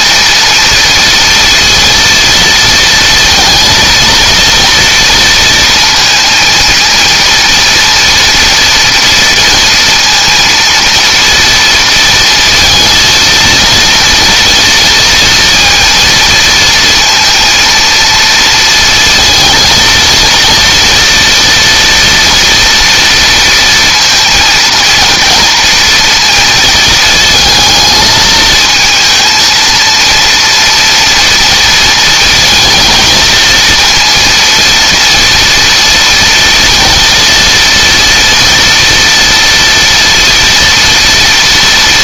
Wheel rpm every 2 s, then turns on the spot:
230, 230, 230, 230, 230, 230, 230, 230, 230, 220, 230, 240, 240, 230, 220, 230, 220, 230, 230, 230, 230.
none